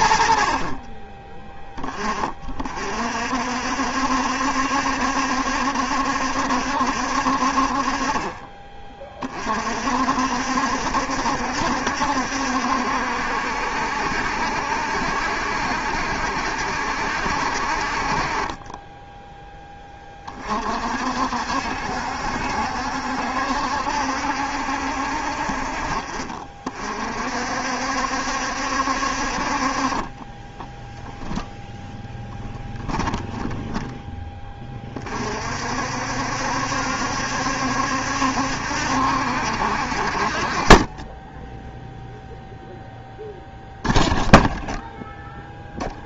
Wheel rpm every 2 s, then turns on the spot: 20, 60, 70, 40, 50, 70, 70, 70, 50, 10, 60, 70, 50, 60, 40, 0, 10, 50, 70, 60, 10, 10, 0.
none